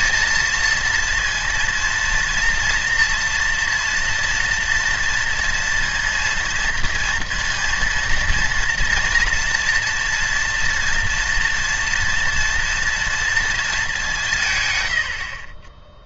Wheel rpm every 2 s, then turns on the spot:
230, 230, 230, 230, 230, 240, 230, 130.
none